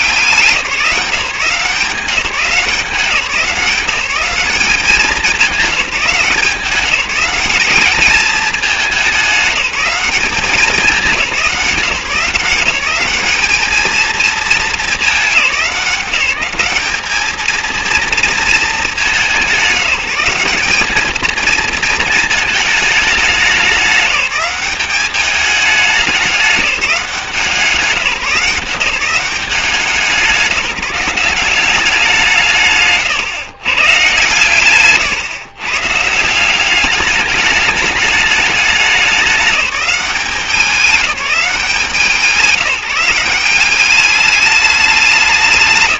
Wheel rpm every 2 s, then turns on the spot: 170, 170, 190, 180, 210, 200, 190, 210, 200, 220, 200, 220, 200, 200, 170, 180, 140, 130, 190, 210, 180, 170, 210.
none